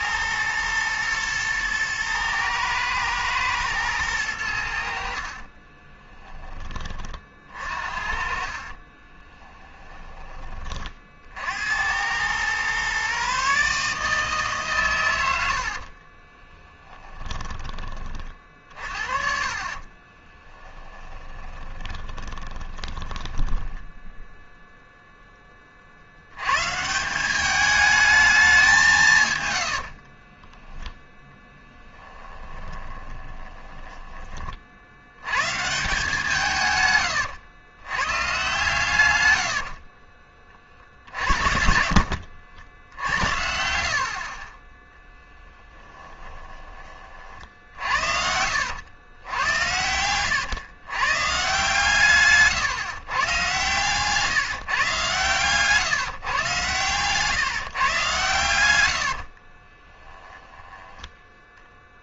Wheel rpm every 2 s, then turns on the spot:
120, 110, 70, 30, 30, 40, 130, 130, 10, 40, 10, 20, 0, 150, 190, 10, 20, 50, 140, 130, 40, 80, 10, 30, 100, 120, 140, 140, 130, 90, 10.
8-10 16-24 32-34 42-44 58-60